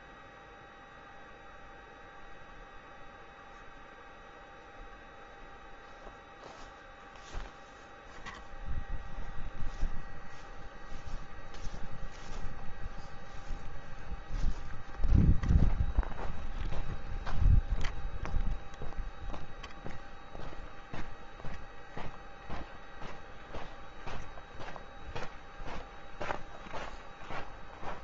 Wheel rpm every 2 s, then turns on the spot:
0, 0, 0, 0, 0, 0, 0, 0, 0, 0, 0, 0, 0, 0.
none